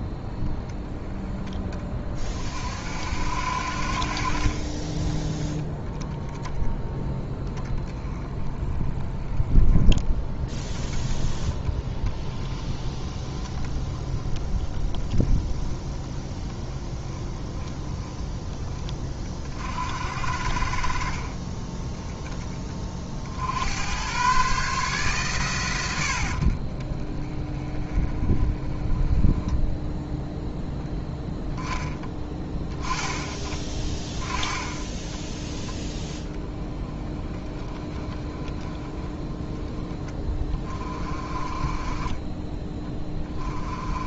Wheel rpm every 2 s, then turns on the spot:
10, 60, 30, 30, 10, 10, 10, 20, 10, 20, 40, 30, 140, 50, 20, 10, 10, 20, 20, 30, 20, 20.
none